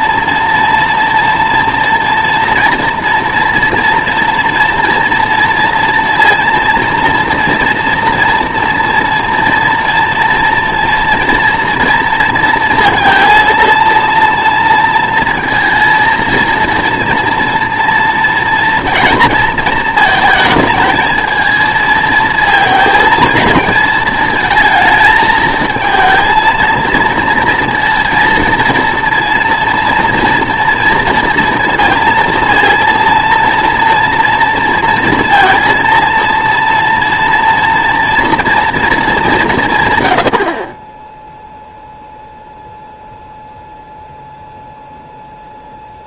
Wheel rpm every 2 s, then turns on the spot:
230, 240, 240, 230, 230, 240, 230, 230, 230, 230, 220, 230, 220, 230, 230, 230, 230, 230, 230, 230, 30, 0, 0.
none